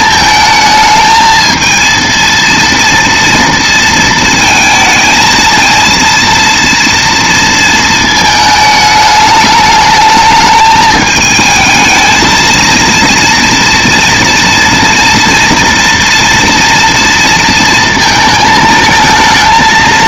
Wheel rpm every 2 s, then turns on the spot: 220, 230, 220, 230, 220, 220, 230, 230, 230, 220.
none